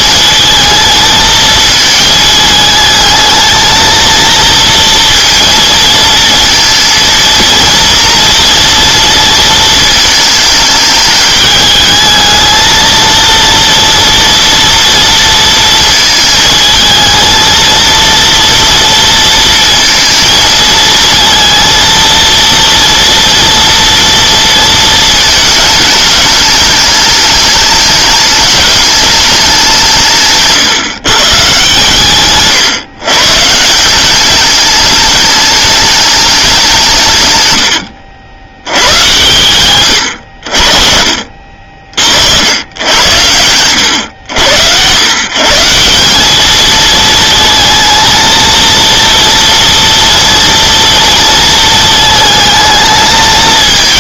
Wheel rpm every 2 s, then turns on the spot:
220, 220, 230, 230, 230, 220, 220, 240, 220, 230, 230, 230, 230, 210, 210, 150, 140, 200, 190, 90, 60, 80, 100, 210, 230, 230, 220.
none